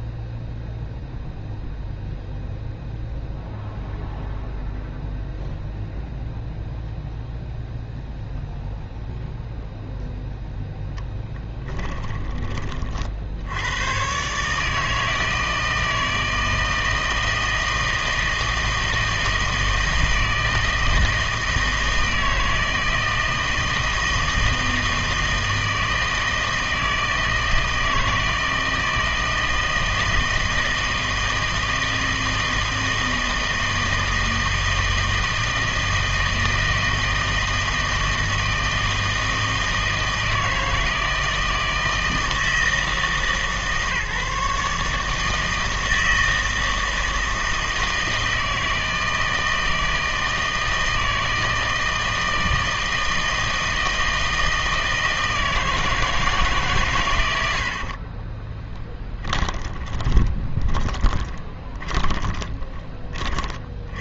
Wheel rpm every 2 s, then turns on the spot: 0, 0, 0, 0, 0, 0, 30, 150, 160, 160, 160, 160, 160, 160, 160, 160, 160, 160, 160, 160, 160, 160, 150, 160, 160, 160, 160, 160, 150, 30, 30, 20.
58-62